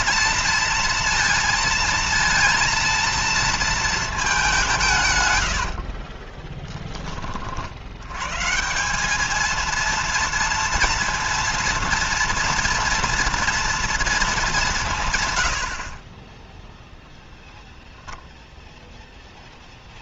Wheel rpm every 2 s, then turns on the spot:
230, 230, 160, 20, 180, 230, 230, 160, 10, 0.
16-18